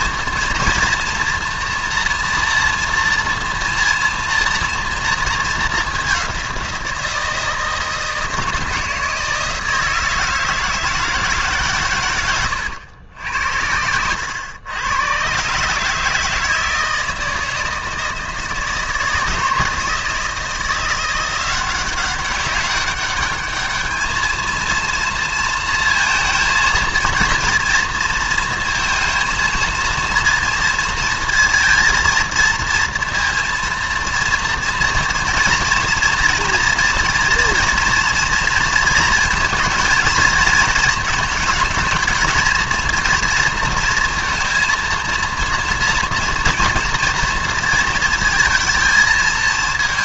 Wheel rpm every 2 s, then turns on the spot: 230, 230, 230, 180, 160, 160, 110, 100, 160, 160, 170, 200, 230, 230, 230, 230, 230, 230, 240, 230, 220, 230, 230, 230, 230.
none